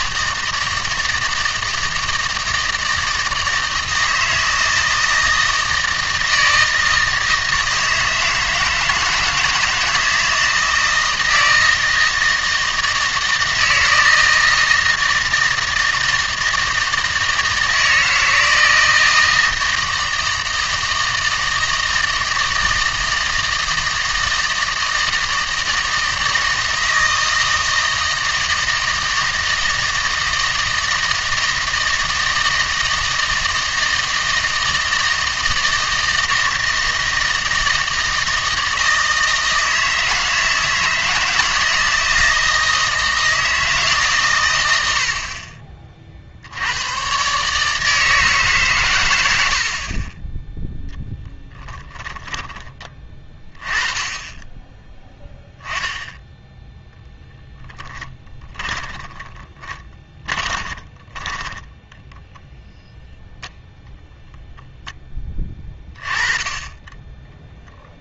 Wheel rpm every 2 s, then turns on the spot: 160, 160, 160, 160, 160, 160, 160, 160, 160, 160, 160, 160, 160, 160, 160, 160, 160, 160, 160, 160, 170, 160, 70, 110, 120, 0, 30, 10, 0, 20, 20, 0, 0, 20.
58-62